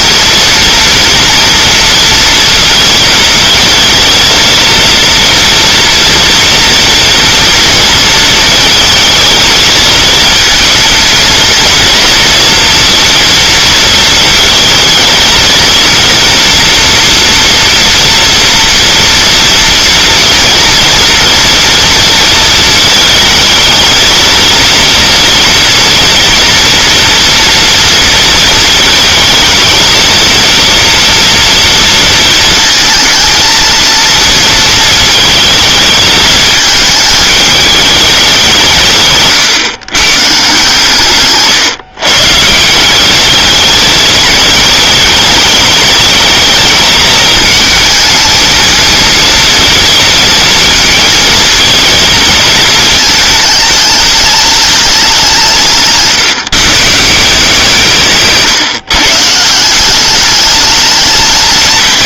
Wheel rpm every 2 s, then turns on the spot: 230, 230, 230, 230, 220, 230, 230, 220, 230, 230, 230, 220, 230, 230, 220, 230, 230, 220, 220, 160, 140, 190, 220, 220, 220, 230, 220, 200, 160, 140, 210.
none